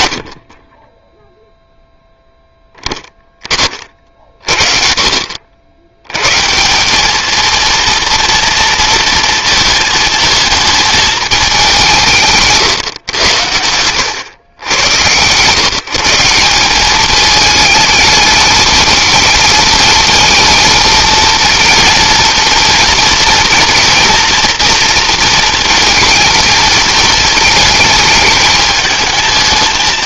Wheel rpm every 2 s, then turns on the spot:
20, 10, 40, 190, 230, 220, 130, 110, 200, 220, 220, 230, 230, 220, 220.
none